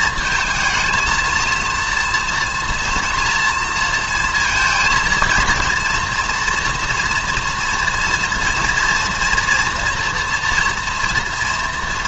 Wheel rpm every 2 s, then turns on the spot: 220, 240, 230, 240, 230, 240.
none